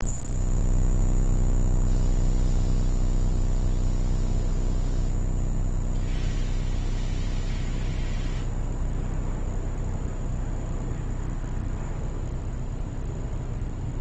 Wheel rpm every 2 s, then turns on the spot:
0, 0, 0, 0, 0, 0, 0.
none